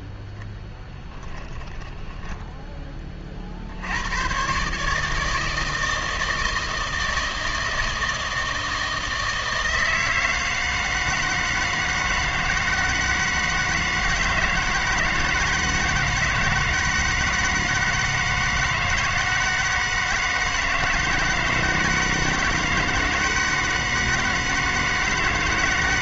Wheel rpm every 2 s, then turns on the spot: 10, 20, 130, 160, 160, 160, 160, 160, 160, 160, 160, 160, 160.
none